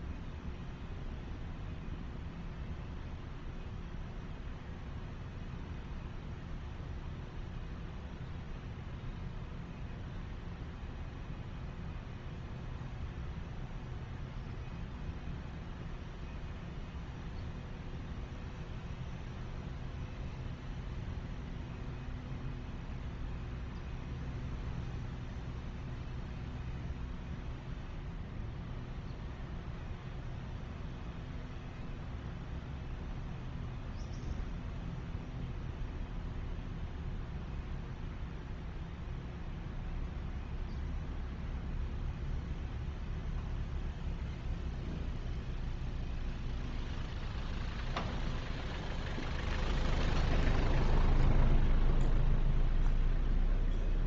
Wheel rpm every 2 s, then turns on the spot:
0, 0, 0, 0, 0, 0, 0, 0, 0, 0, 0, 0, 0, 0, 0, 0, 0, 0, 0, 0, 0, 0, 0, 0, 0, 0, 0.
none